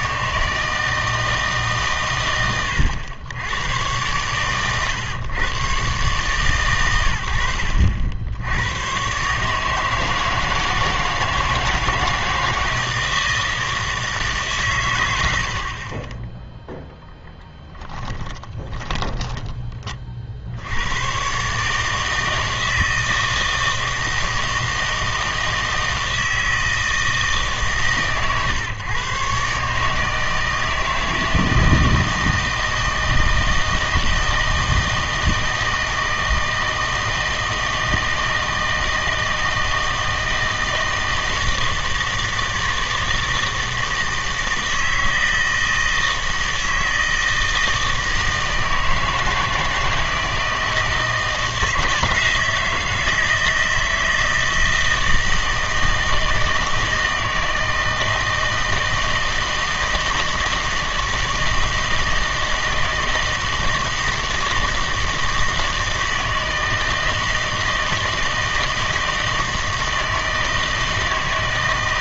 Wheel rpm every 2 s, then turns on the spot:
160, 100, 120, 120, 100, 160, 160, 120, 0, 20, 90, 160, 160, 160, 130, 160, 160, 160, 160, 160, 160, 160, 160, 160, 160, 160, 160, 160, 160, 160, 160, 160, 160, 160, 160, 160.
18-20